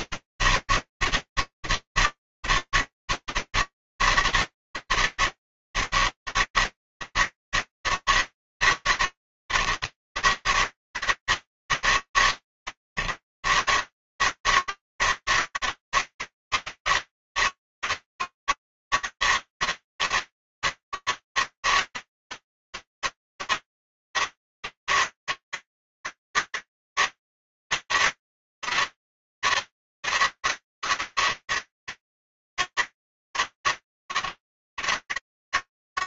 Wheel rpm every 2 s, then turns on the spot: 160, 160, 160, 160, 160, 140, 140, 150, 160, 160, 160, 160, 150, 160, 160, 150, 150, 150.
none